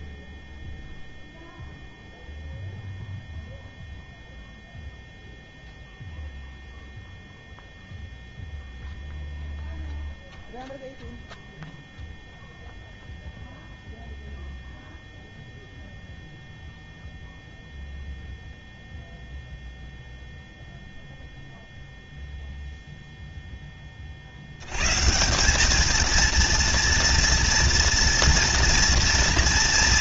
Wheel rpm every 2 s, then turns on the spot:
0, 0, 0, 0, 0, 0, 0, 0, 0, 0, 0, 0, 100, 230, 230.
none